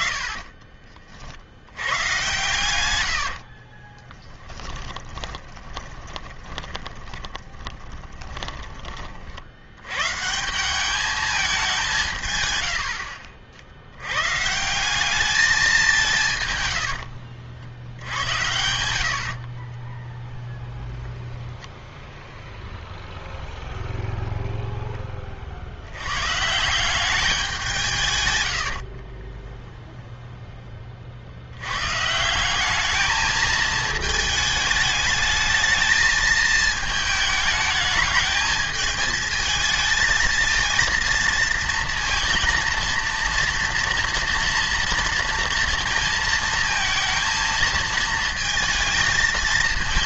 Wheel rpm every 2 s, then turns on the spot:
30, 110, 10, 20, 20, 180, 100, 170, 120, 80, 0, 0, 0, 170, 70, 10, 200, 220, 220, 220, 230, 230, 230, 230, 220.
4-10 16-18 28-30